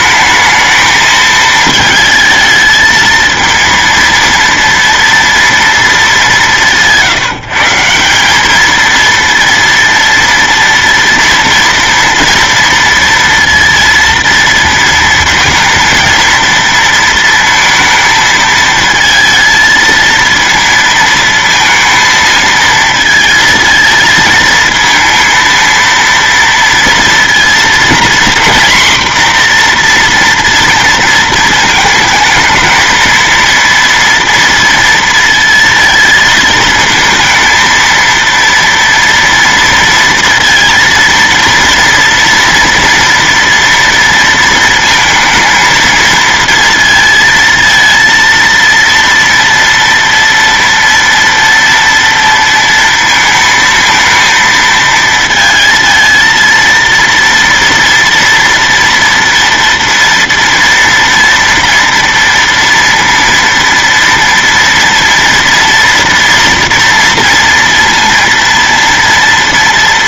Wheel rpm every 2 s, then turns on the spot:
220, 220, 230, 160, 220, 230, 230, 230, 230, 220, 230, 220, 220, 230, 240, 230, 220, 230, 220, 230, 230, 240, 230, 230, 230, 230, 230, 220, 230, 230, 230, 230, 230, 230, 230.
none